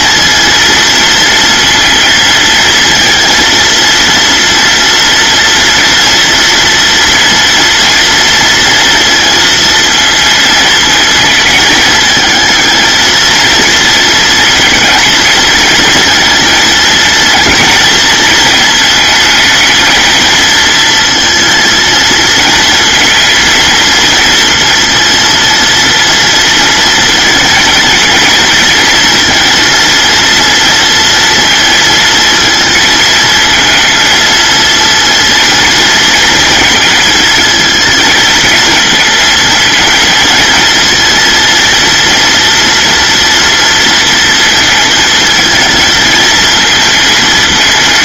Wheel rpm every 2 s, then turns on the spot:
230, 230, 230, 230, 230, 220, 220, 230, 230, 220, 230, 220, 230, 230, 230, 230, 230, 230, 220, 230, 230, 230, 220, 220.
none